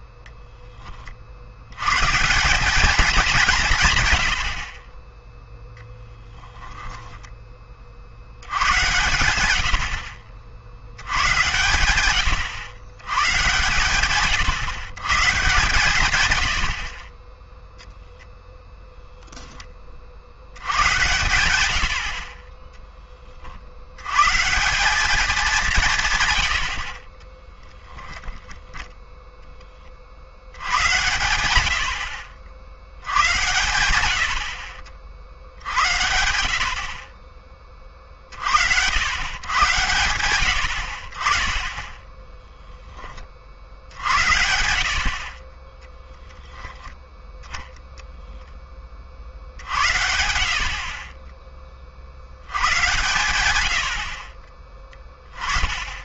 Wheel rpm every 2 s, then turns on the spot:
40, 210, 20, 10, 100, 90, 110, 140, 40, 0, 100, 10, 180, 60, 10, 110, 80, 50, 50, 70, 70, 10, 70, 10, 10, 60, 100, 20.
6-8 52-54